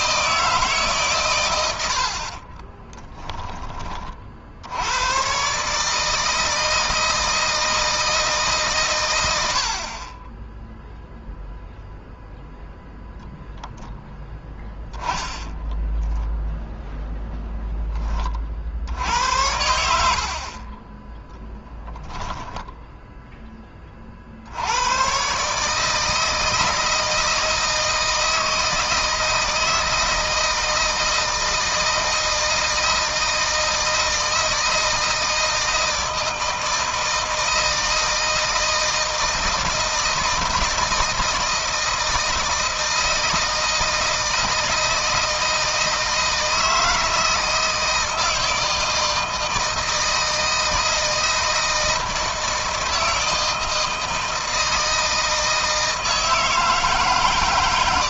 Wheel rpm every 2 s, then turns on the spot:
150, 30, 80, 160, 130, 0, 0, 10, 0, 60, 30, 10, 90, 160, 160, 160, 160, 160, 160, 160, 160, 160, 160, 160, 160, 160, 160, 160, 150.
2-4 14-16 20-22